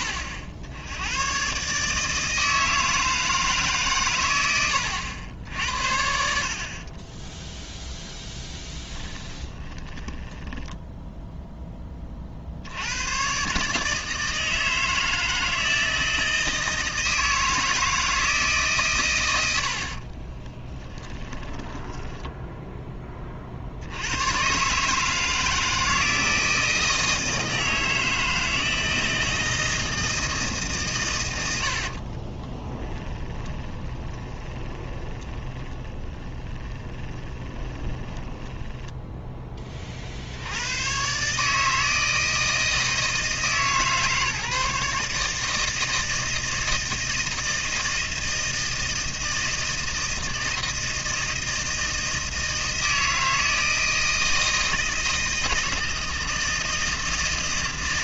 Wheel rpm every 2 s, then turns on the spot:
80, 160, 80, 30, 10, 10, 90, 160, 160, 130, 10, 10, 140, 160, 160, 140, 20, 20, 20, 10, 110, 160, 150, 160, 160, 160, 160, 160, 160.
8-12 20-22 32-40